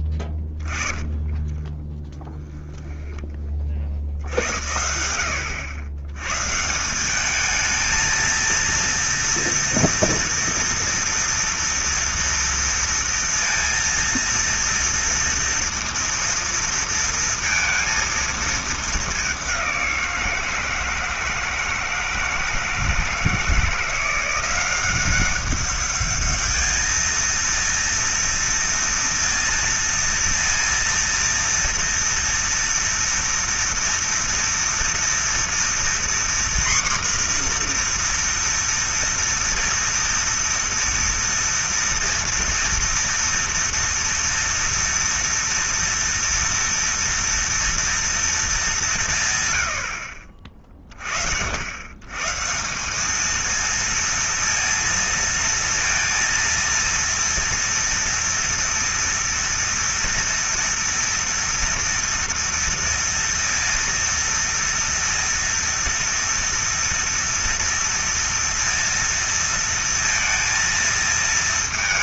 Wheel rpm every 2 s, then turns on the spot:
20, 30, 70, 160, 230, 230, 230, 230, 230, 220, 160, 160, 180, 220, 230, 230, 230, 230, 250, 240, 230, 230, 230, 230, 200, 40, 170, 230, 230, 230, 230, 230, 230, 230, 230, 230.
0-4